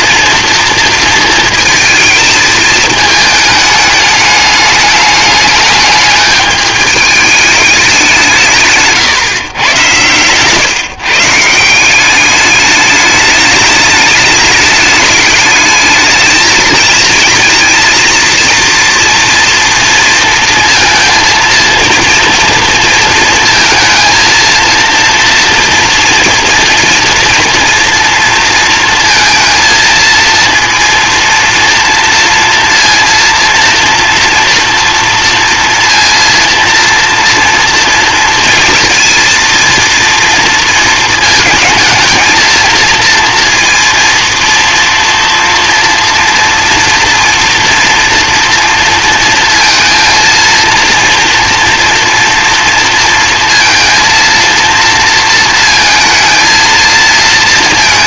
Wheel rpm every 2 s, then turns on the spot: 230, 220, 210, 210, 160, 150, 210, 210, 220, 230, 230, 230, 230, 230, 230, 230, 230, 230, 230, 230, 230, 220, 230, 240, 230, 230, 230, 230, 230.
none